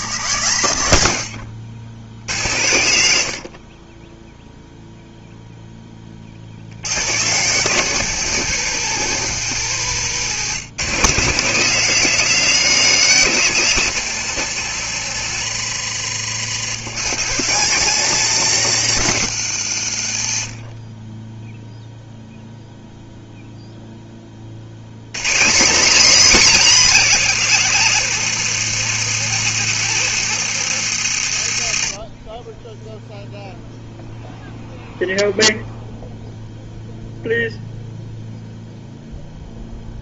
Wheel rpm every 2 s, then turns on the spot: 90, 100, 0, 110, 170, 160, 190, 150, 160, 170, 20, 0, 150, 280, 220, 160, 0, 0, 0, 0.
none